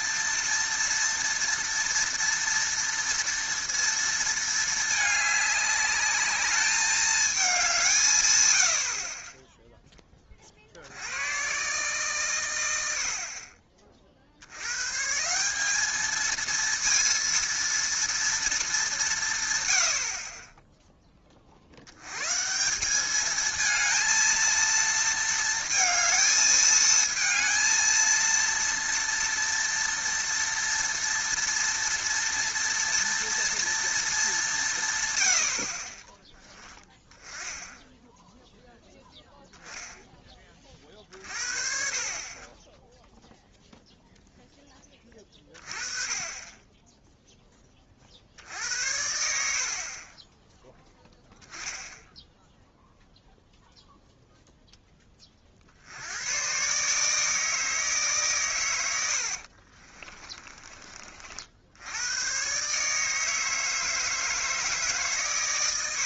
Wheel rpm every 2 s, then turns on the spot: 230, 230, 220, 210, 100, 50, 100, 90, 230, 210, 10, 180, 230, 220, 230, 230, 230, 190, 10, 0, 40, 20, 10, 10, 70, 10, 0, 0, 130, 110, 20, 130, 160.
60-62